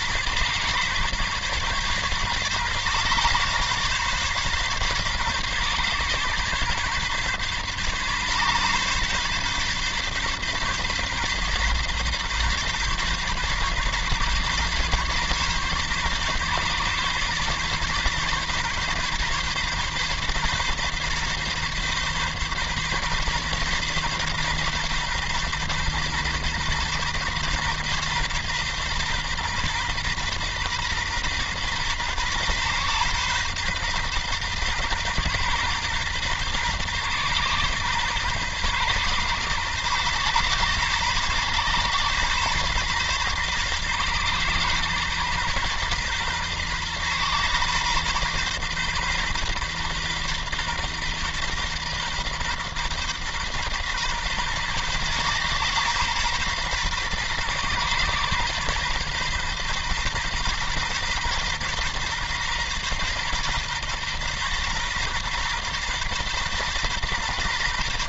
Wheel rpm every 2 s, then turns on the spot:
140, 140, 140, 130, 140, 140, 130, 140, 140, 140, 140, 140, 140, 130, 130, 130, 120, 130, 130, 120, 130, 120, 120, 130, 130, 130, 130, 130, 130, 130, 120, 130, 120, 120.
none